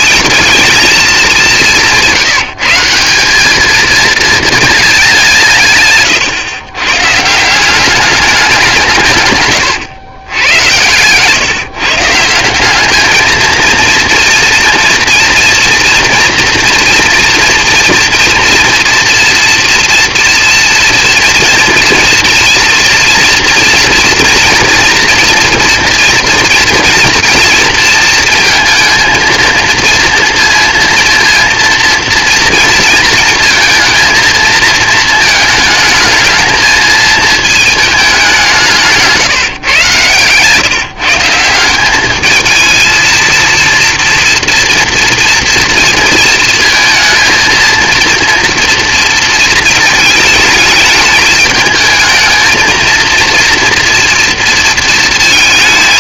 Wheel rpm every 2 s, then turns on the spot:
220, 190, 200, 140, 150, 120, 210, 230, 240, 230, 230, 230, 240, 240, 230, 230, 220, 220, 220, 160, 160, 230, 240, 230, 230, 210, 230, 230.
none